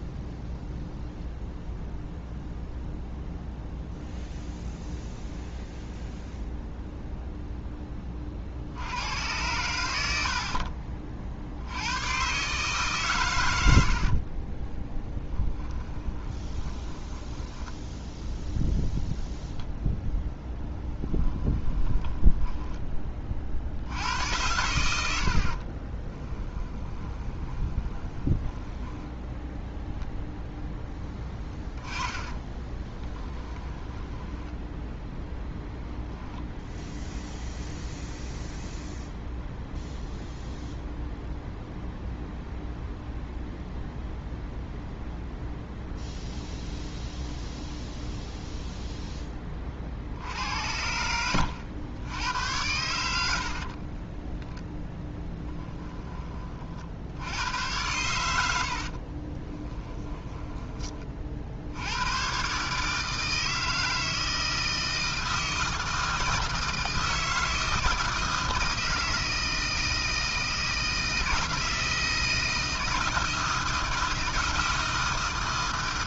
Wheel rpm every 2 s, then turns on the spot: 0, 0, 0, 0, 70, 50, 140, 20, 20, 0, 10, 10, 90, 10, 10, 0, 20, 10, 0, 0, 0, 0, 0, 0, 0, 80, 90, 0, 40, 70, 20, 140, 160, 160, 160, 160, 160, 160.
14-18 20-24 26-30 32-36